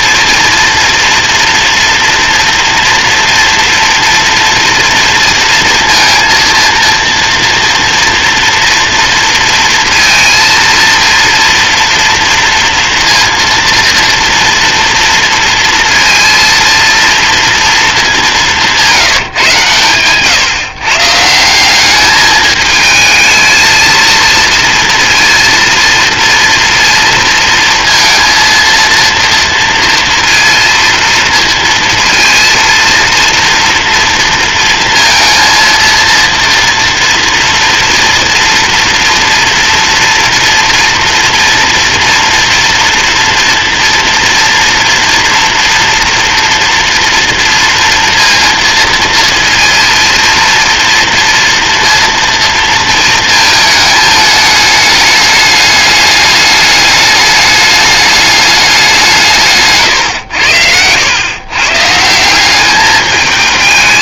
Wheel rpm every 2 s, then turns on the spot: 240, 230, 240, 230, 230, 230, 230, 230, 230, 130, 170, 220, 230, 230, 230, 230, 230, 230, 230, 240, 230, 240, 230, 230, 230, 230, 220, 210, 210, 150, 120, 220.
none